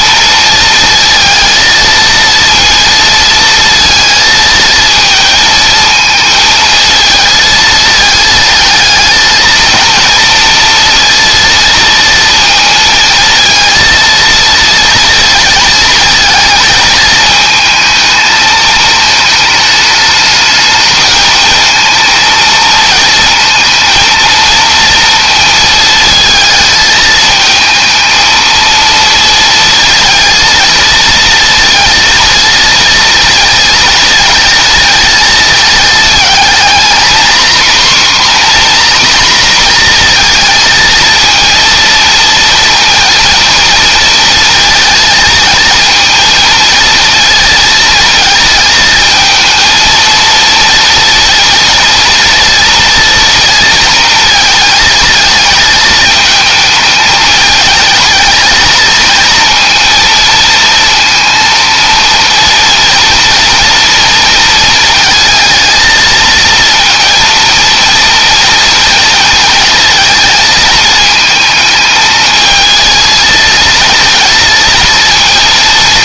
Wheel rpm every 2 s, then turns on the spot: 230, 230, 230, 220, 220, 230, 230, 230, 220, 220, 220, 230, 230, 220, 230, 230, 230, 230, 240, 250, 230, 230, 220, 230, 220, 230, 230, 230, 220, 220, 230, 230, 220, 230, 230, 220, 220, 230.
none